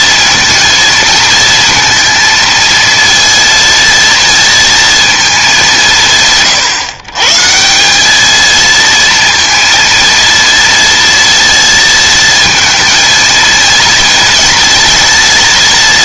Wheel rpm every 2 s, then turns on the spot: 230, 230, 230, 140, 220, 230, 230, 230.
none